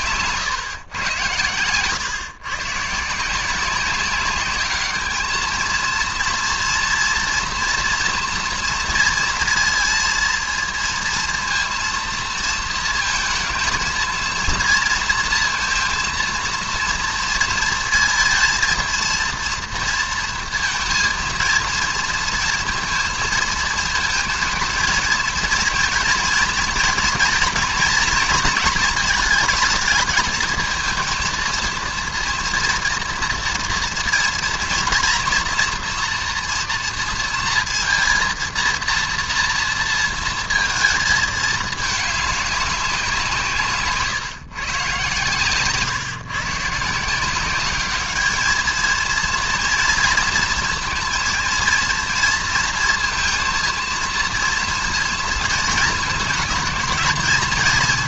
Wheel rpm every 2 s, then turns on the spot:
130, 140, 200, 230, 230, 230, 230, 230, 230, 220, 230, 230, 220, 230, 230, 220, 230, 230, 230, 230, 230, 200, 140, 150, 220, 230, 230, 230, 220.
none